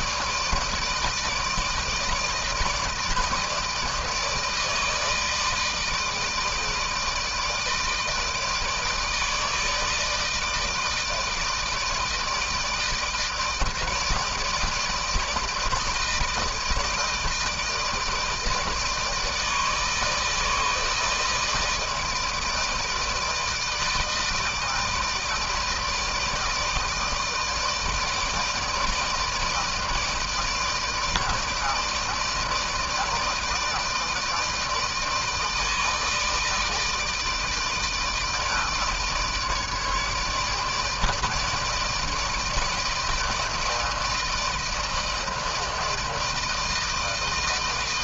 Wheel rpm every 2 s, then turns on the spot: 160, 160, 160, 160, 160, 160, 160, 160, 160, 160, 150, 160, 160, 160, 160, 160, 160, 160, 160, 160, 150, 160, 160, 160.
none